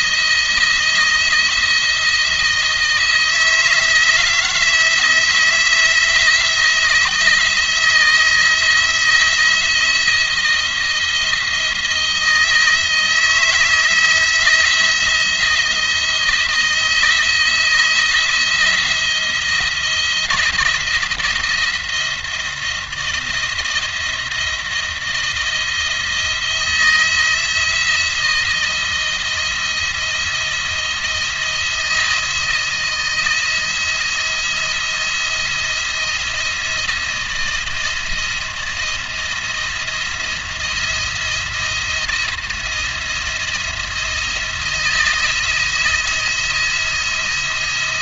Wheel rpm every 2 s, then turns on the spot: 170, 170, 170, 160, 160, 170, 170, 170, 160, 170, 170, 160, 170, 170, 170, 170, 170, 170, 170, 170, 170, 170, 170, 170.
none